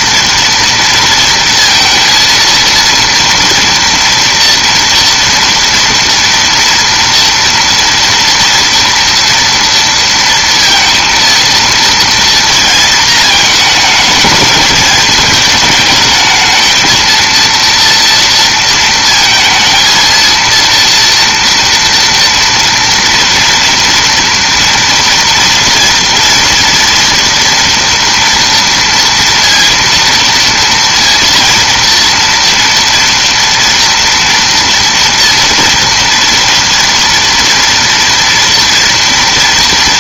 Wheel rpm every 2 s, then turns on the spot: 230, 230, 230, 240, 230, 230, 230, 220, 220, 230, 230, 230, 230, 240, 230, 230, 230, 240, 230, 240.
none